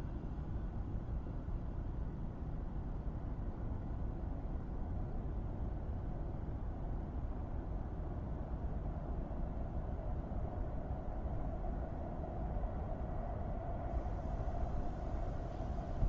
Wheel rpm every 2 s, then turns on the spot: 0, 0, 0, 0, 0, 0, 0, 0.
none